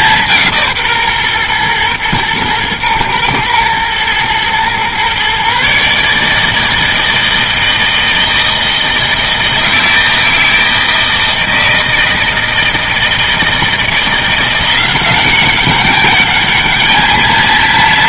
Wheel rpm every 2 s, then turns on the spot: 150, 110, 120, 160, 160, 160, 160, 180, 210.
none